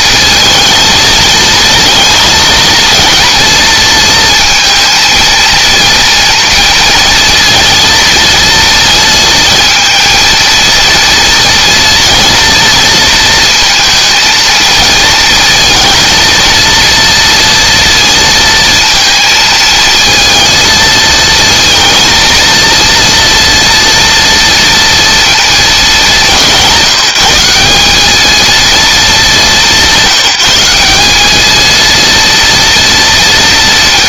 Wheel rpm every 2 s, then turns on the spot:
220, 230, 230, 230, 230, 230, 230, 220, 230, 230, 230, 230, 230, 180, 220, 190, 230.
none